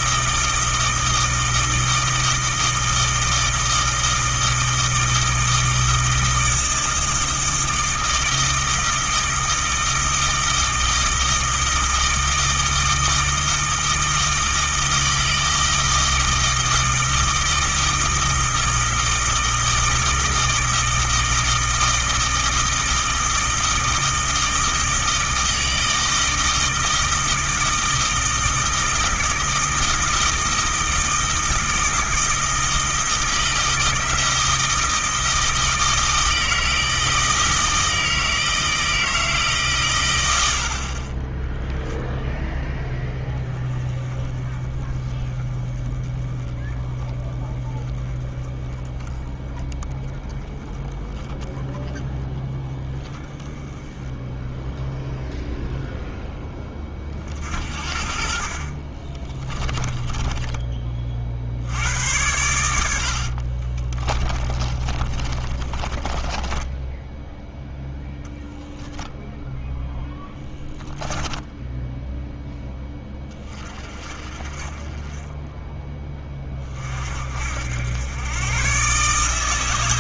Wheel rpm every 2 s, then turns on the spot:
160, 160, 160, 160, 160, 160, 160, 160, 160, 160, 160, 160, 160, 160, 160, 160, 160, 160, 160, 160, 50, 10, 20, 10, 10, 10, 10, 0, 30, 50, 30, 80, 30, 20, 0, 10, 10, 30, 40, 130.
58-60 64-68 70-72